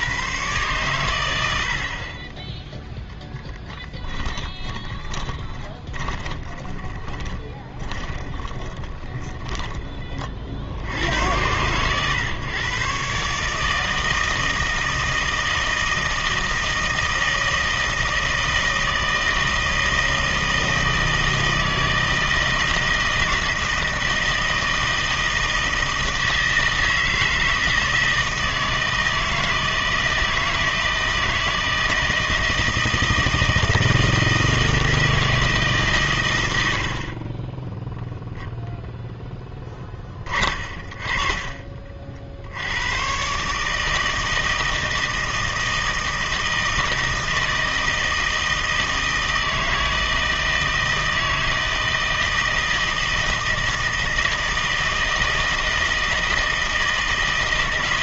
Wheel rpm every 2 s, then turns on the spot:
120, 10, 30, 20, 20, 60, 120, 160, 160, 160, 160, 160, 160, 160, 160, 160, 160, 160, 90, 0, 30, 80, 160, 160, 160, 160, 160, 160, 160.
4-10 36-38